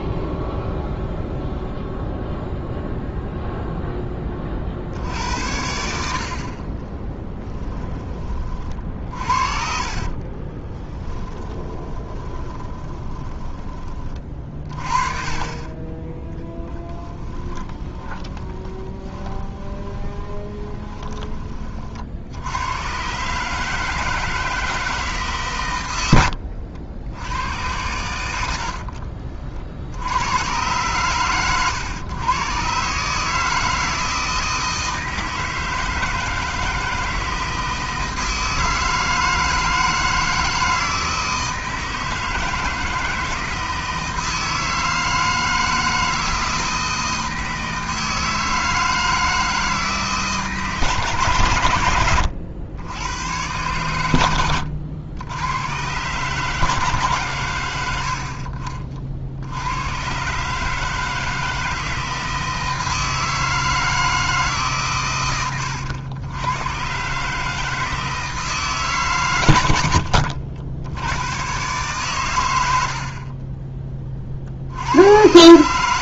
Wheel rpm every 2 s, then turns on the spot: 0, 0, 60, 30, 40, 10, 10, 40, 10, 20, 10, 110, 160, 60, 80, 120, 130, 160, 160, 160, 160, 160, 160, 160, 160, 160, 100, 90, 150, 50, 150, 160, 140, 120, 150, 80, 80, 80.
8-14 16-20